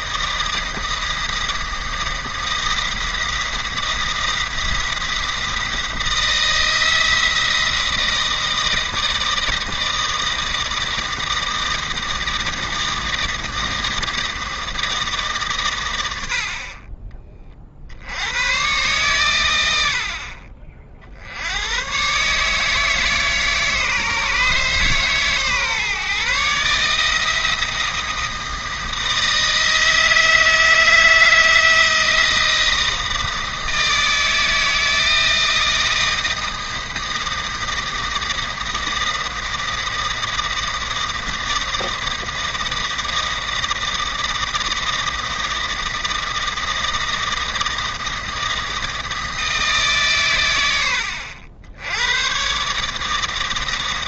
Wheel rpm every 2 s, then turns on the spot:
160, 170, 170, 170, 160, 160, 160, 160, 40, 120, 50, 150, 150, 150, 160, 160, 160, 160, 160, 160, 160, 160, 160, 160, 160, 90, 150.
none